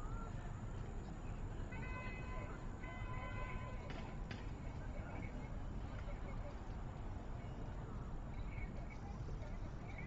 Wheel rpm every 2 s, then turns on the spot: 0, 0, 0, 0, 0.
none